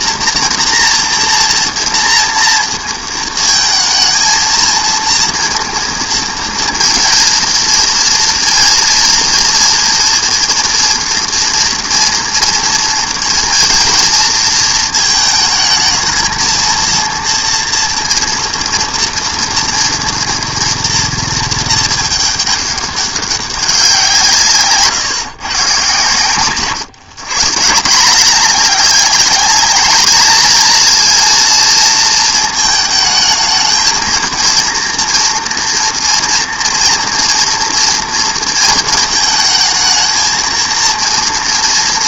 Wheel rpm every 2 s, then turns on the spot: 230, 230, 230, 230, 230, 230, 230, 230, 220, 230, 230, 200, 150, 130, 200, 220, 220, 230, 240, 230, 230.
none